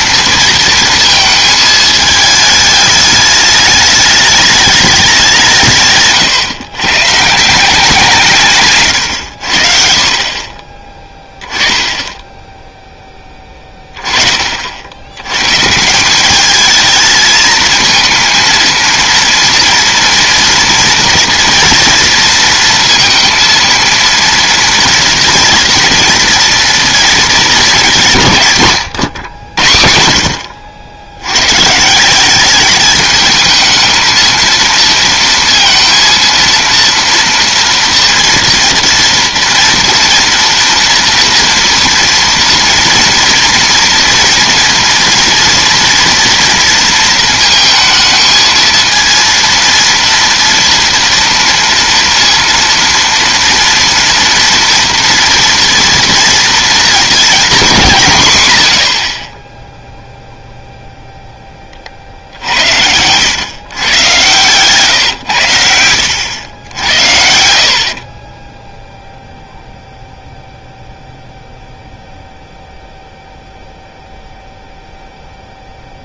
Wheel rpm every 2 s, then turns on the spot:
230, 210, 210, 120, 140, 30, 0, 50, 210, 230, 230, 230, 230, 230, 150, 80, 200, 230, 230, 230, 230, 230, 230, 230, 220, 230, 230, 230, 240, 130, 0, 80, 130, 90, 20, 0, 0, 0.
62-64 68-70